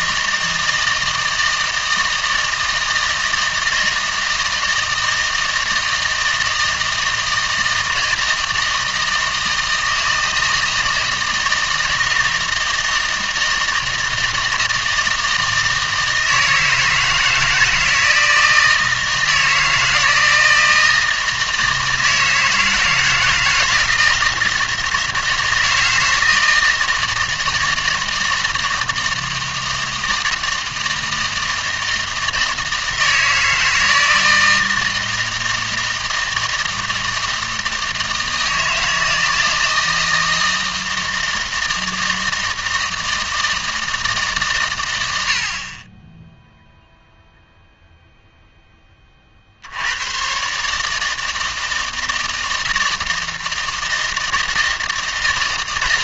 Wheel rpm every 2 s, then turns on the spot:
160, 160, 160, 160, 160, 160, 160, 160, 160, 160, 160, 160, 160, 160, 160, 160, 160, 160, 160, 160, 160, 160, 110, 0, 10, 150, 160, 160.
none